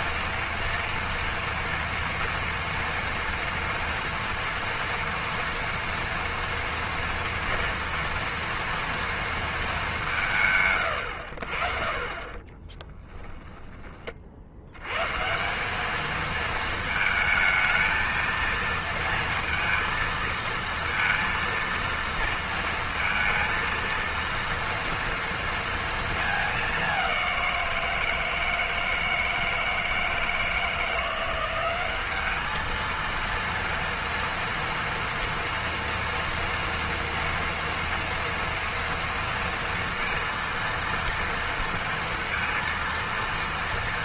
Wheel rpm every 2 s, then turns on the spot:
230, 230, 230, 230, 230, 140, 20, 100, 220, 230, 230, 230, 230, 200, 160, 160, 220, 240, 230, 230, 230, 230.
12-14